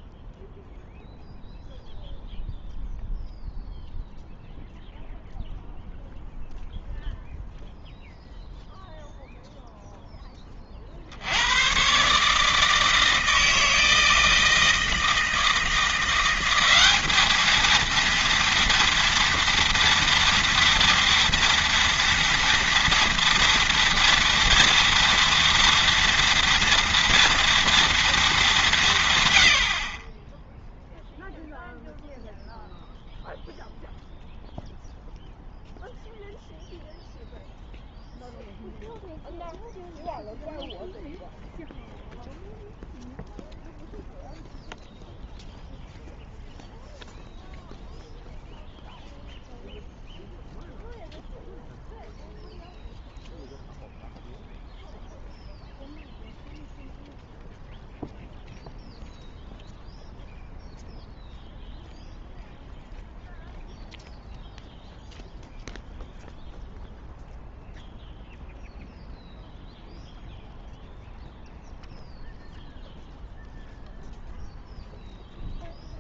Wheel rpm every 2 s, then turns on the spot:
0, 0, 0, 0, 0, 30, 150, 160, 190, 230, 230, 230, 230, 230, 190, 0, 0, 0, 0, 0, 0, 0, 0, 0, 0, 0, 0, 0, 0, 0, 0, 0, 0, 0, 0, 0, 0, 0.
none